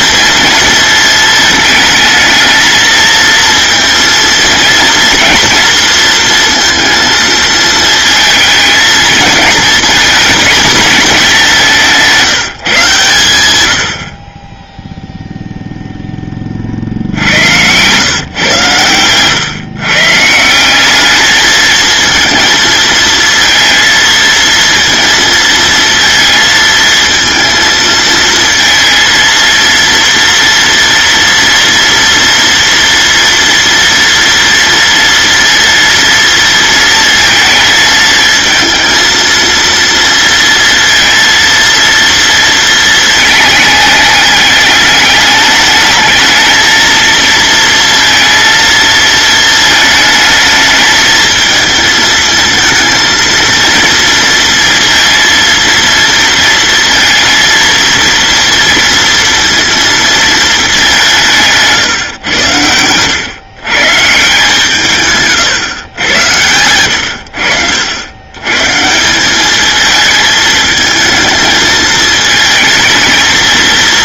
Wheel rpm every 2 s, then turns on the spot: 220, 230, 230, 230, 230, 220, 130, 0, 60, 110, 210, 230, 230, 230, 230, 230, 230, 230, 230, 230, 230, 230, 210, 230, 220, 220, 230, 230, 230, 230, 190, 110, 140, 80, 170, 220, 220.
none